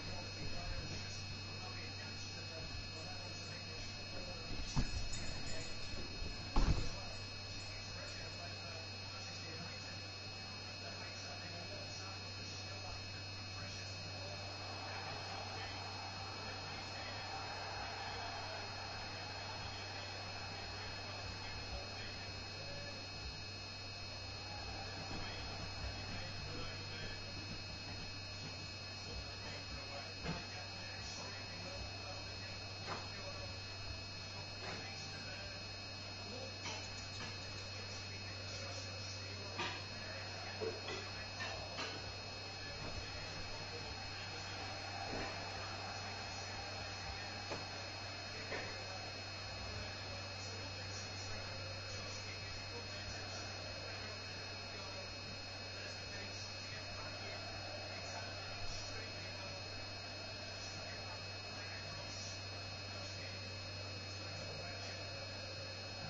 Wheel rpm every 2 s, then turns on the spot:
0, 0, 0, 0, 0, 0, 0, 0, 0, 0, 0, 0, 0, 0, 0, 0, 0, 0, 0, 0, 0, 0, 0, 0, 0, 0, 0, 0, 0, 0, 0, 0, 0.
none